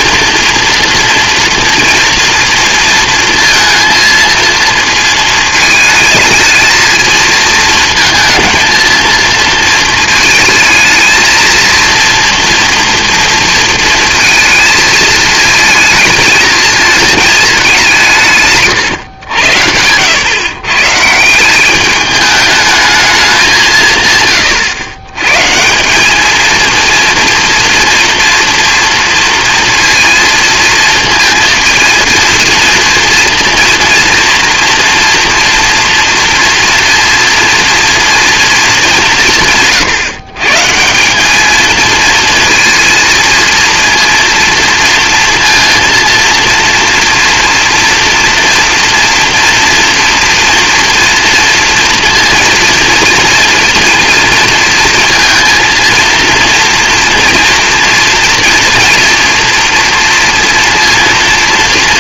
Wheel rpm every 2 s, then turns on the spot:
230, 230, 230, 220, 230, 220, 230, 220, 220, 130, 140, 210, 100, 230, 230, 230, 230, 230, 230, 210, 150, 230, 230, 230, 230, 230, 230, 230, 230, 230, 240.
18-20